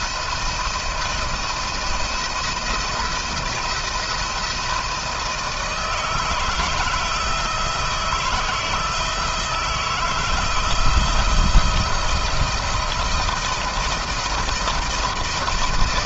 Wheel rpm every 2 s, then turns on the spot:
170, 160, 170, 160, 160, 170, 170, 170.
none